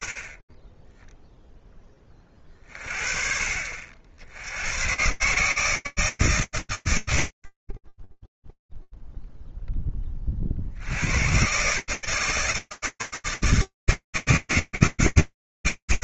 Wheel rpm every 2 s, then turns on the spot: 20, 50, 120, 100, 0, 60, 160, 140.
none